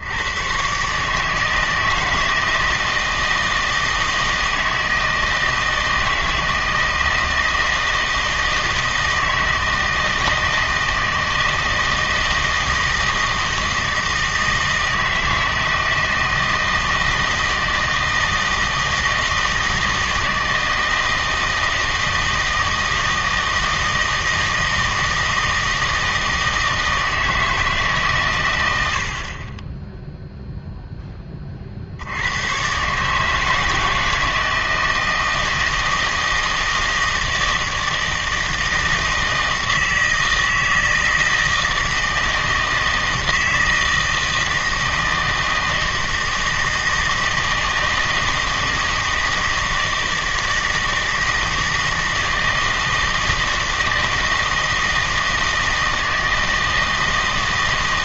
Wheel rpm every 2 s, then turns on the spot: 130, 160, 160, 160, 160, 160, 160, 160, 160, 160, 160, 160, 160, 160, 80, 0, 130, 160, 160, 160, 160, 160, 160, 160, 160, 160, 160, 160, 160.
none